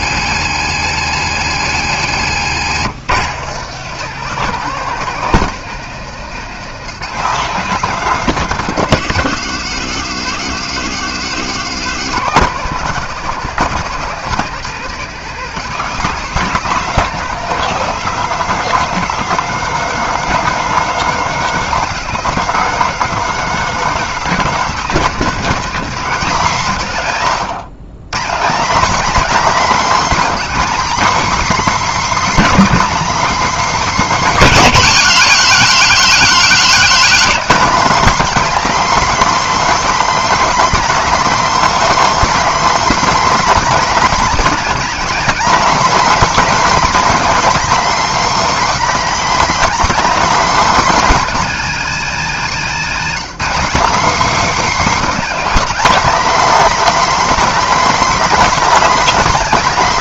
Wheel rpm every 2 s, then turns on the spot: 130, 130, 170, 170, 160, 150, 180, 170, 190, 200, 210, 200, 200, 160, 260, 290, 290, 260, 260, 300, 300, 300, 280, 300, 300, 280, 230, 280, 300, 290.
14-16